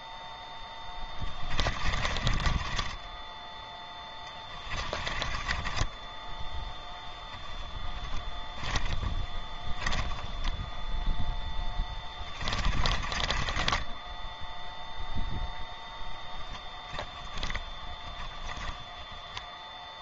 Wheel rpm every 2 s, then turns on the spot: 10, 20, 20, 10, 10, 10, 40, 0, 20, 10.
0-10 12-14 16-20